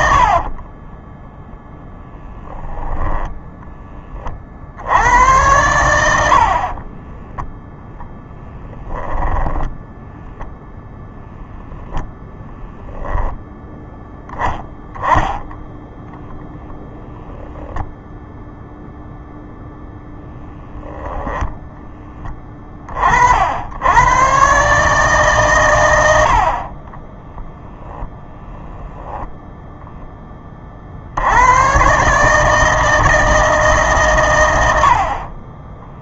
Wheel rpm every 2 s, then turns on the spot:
20, 10, 70, 30, 10, 0, 10, 0, 0, 0, 10, 40, 140, 30, 10, 50, 160, 80.
0-4 6-10 20-22